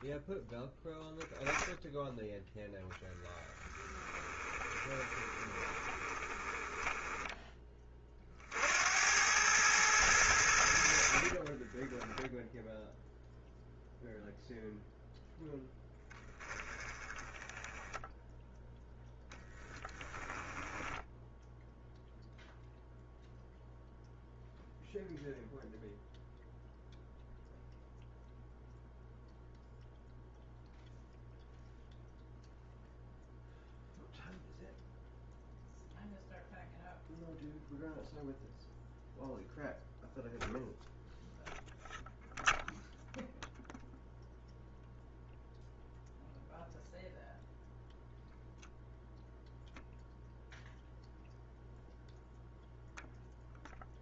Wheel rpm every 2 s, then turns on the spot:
20, 10, 20, 10, 80, 70, 0, 0, 20, 0, 10, 0, 0, 0, 0, 0, 0, 0, 0, 0, 0, 0, 0, 0, 0, 0, 0.
4-8 10-12 20-22